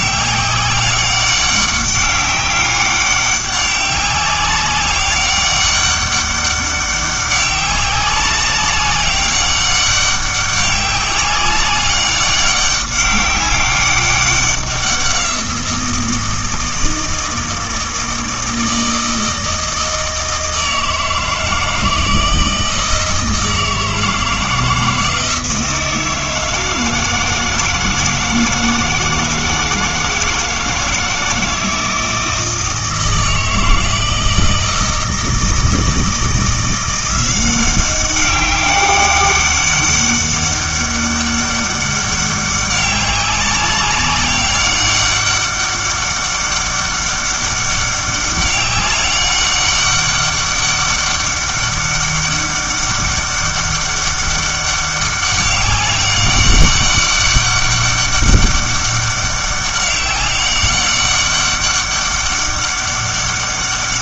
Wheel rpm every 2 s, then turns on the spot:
200, 190, 200, 200, 200, 200, 200, 190, 160, 160, 160, 160, 170, 160, 160, 160, 160, 160, 170, 200, 200, 200, 200, 200, 200, 200, 200, 200, 200, 200, 190, 200.
none